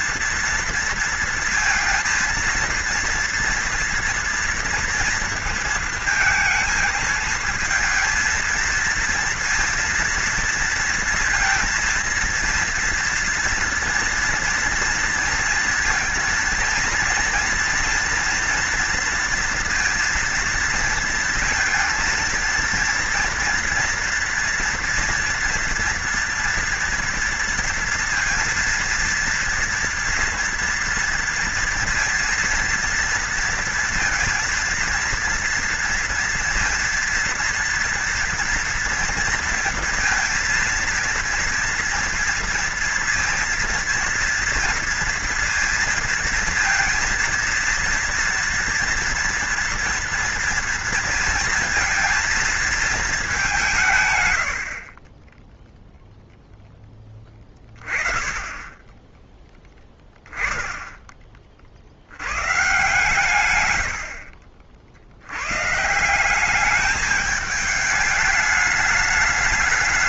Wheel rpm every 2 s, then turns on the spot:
230, 230, 240, 230, 220, 230, 230, 240, 230, 240, 230, 230, 230, 230, 230, 230, 230, 230, 230, 230, 230, 230, 230, 230, 230, 230, 220, 80, 0, 20, 0, 130, 50, 190, 210.
none